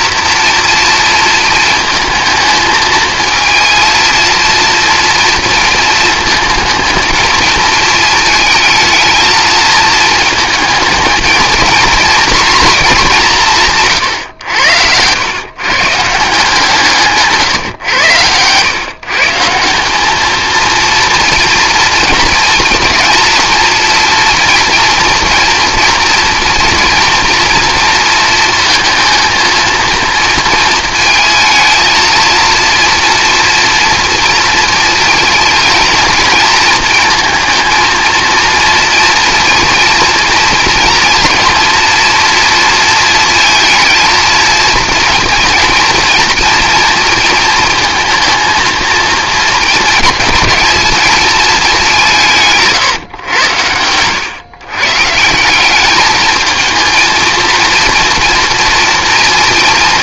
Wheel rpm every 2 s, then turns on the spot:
230, 220, 230, 220, 220, 220, 220, 90, 170, 140, 230, 230, 230, 230, 230, 230, 230, 220, 220, 230, 230, 230, 230, 230, 230, 210, 150, 140, 220, 230.
none